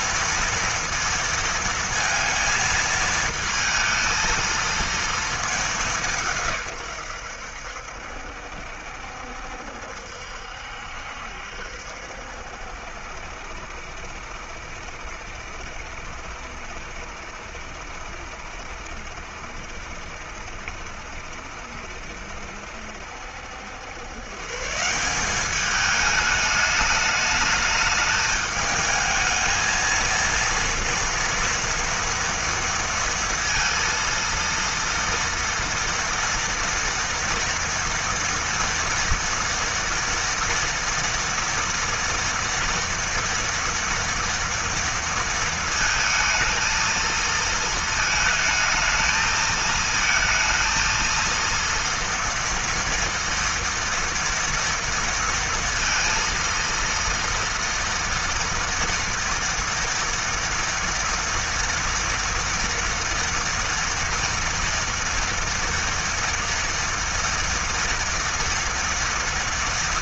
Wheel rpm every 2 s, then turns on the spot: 230, 220, 230, 110, 70, 70, 70, 70, 70, 70, 60, 70, 180, 210, 220, 230, 230, 230, 230, 230, 230, 230, 230, 230, 220, 230, 230, 230, 230, 230, 230, 230, 230, 230, 230.
none